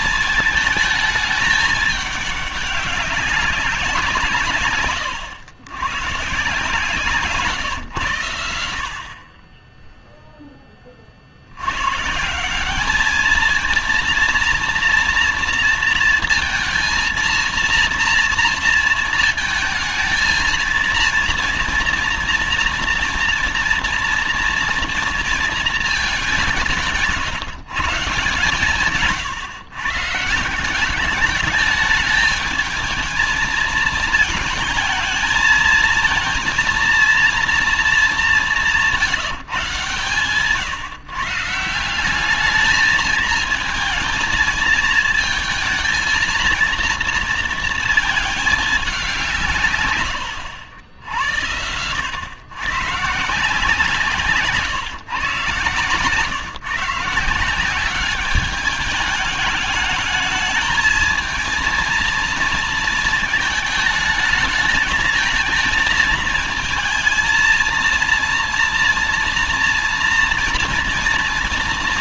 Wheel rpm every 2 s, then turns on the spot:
220, 200, 140, 130, 80, 10, 180, 230, 230, 230, 230, 230, 230, 180, 140, 170, 220, 220, 230, 200, 130, 210, 220, 230, 220, 100, 120, 150, 130, 200, 220, 230, 220, 230, 230, 230.
none